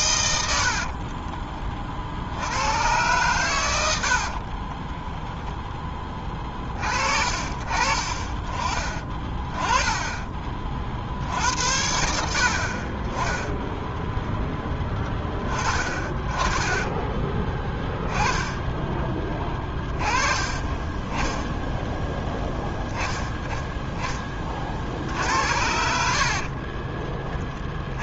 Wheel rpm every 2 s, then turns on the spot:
60, 100, 20, 50, 40, 40, 30, 10, 10, 10, 20, 10, 60, 30.
0-2 4-6 18-20 26-28